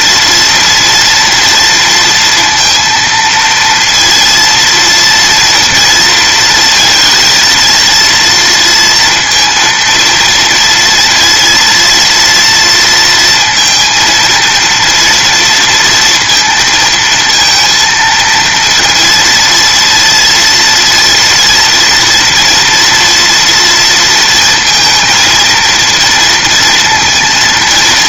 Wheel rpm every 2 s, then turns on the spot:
230, 230, 230, 230, 230, 230, 230, 230, 220, 230, 230, 230, 230, 230.
none